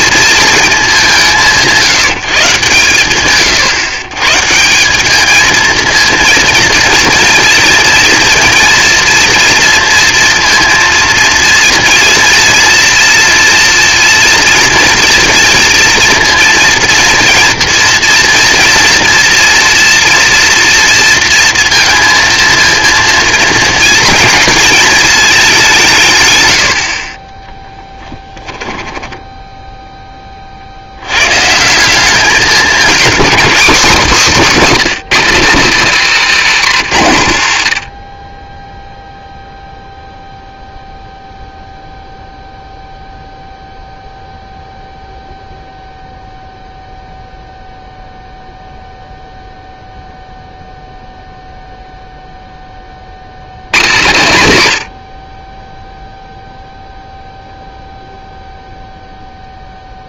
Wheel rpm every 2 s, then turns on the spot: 220, 150, 170, 230, 230, 230, 230, 230, 230, 230, 230, 230, 230, 100, 10, 50, 210, 220, 170, 10, 0, 0, 0, 0, 0, 0, 10, 120, 0, 0.
28-30